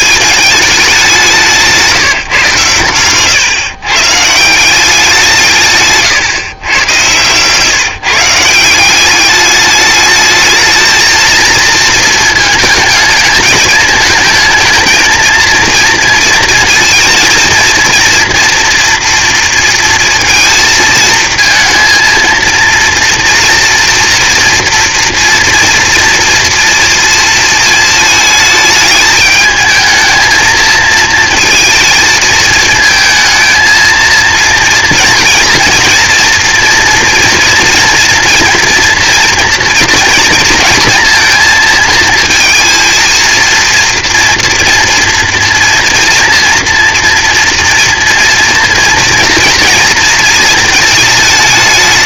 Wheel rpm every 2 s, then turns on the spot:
200, 120, 180, 120, 180, 220, 220, 220, 220, 230, 220, 230, 230, 230, 210, 220, 220, 230, 240, 230, 230, 230, 230, 230, 230, 220.
6-8